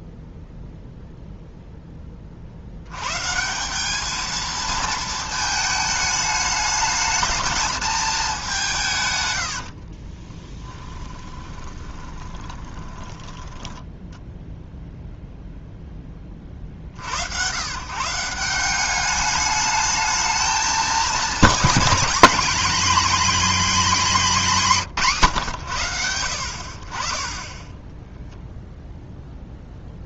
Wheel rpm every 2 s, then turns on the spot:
0, 90, 220, 220, 170, 10, 20, 0, 60, 180, 220, 240, 170, 50, 0.
10-14